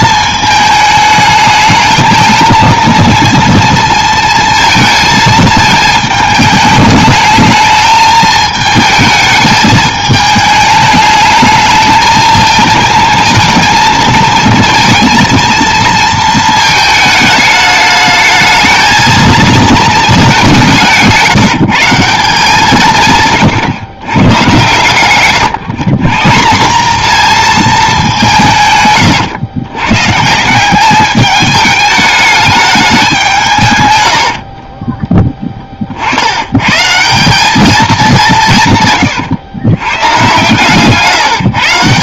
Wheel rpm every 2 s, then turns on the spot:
220, 220, 220, 210, 220, 210, 220, 230, 220, 220, 170, 170, 120, 200, 140, 190, 210, 30, 110, 150, 140.
34-36